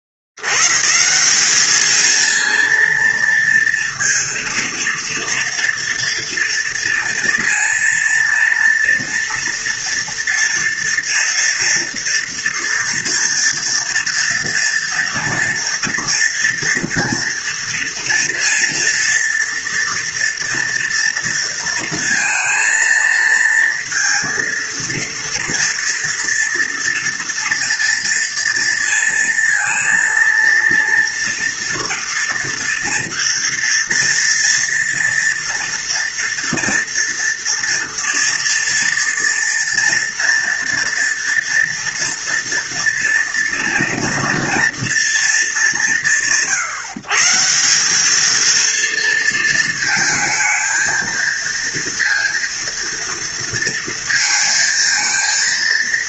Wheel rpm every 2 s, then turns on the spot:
60, 230, 230, 230, 230, 230, 230, 240, 230, 230, 230, 220, 230, 230, 230, 230, 230, 230, 230, 230, 230, 230, 230, 160, 220, 220, 230, 230.
none